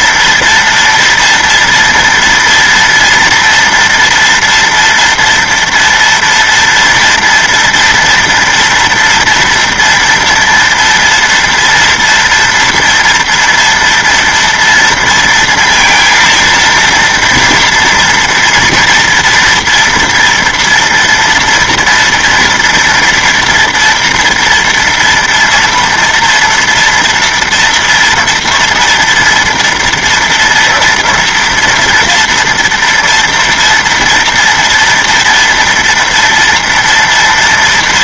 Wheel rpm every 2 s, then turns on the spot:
230, 230, 230, 230, 230, 230, 230, 230, 230, 230, 230, 230, 230, 240, 230, 230, 230, 240, 230.
none